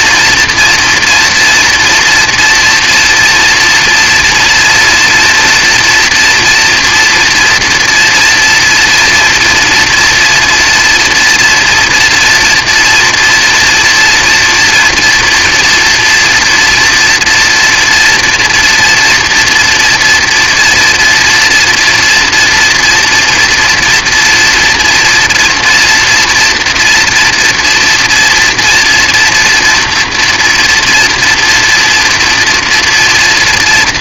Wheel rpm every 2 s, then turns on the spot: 240, 230, 230, 230, 230, 240, 230, 240, 230, 230, 230, 230, 230, 230, 230, 230, 230.
none